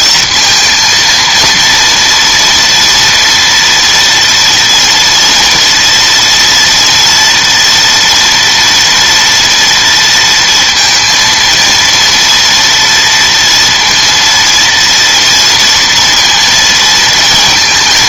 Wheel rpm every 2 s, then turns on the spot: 230, 230, 230, 230, 240, 230, 230, 230, 230.
none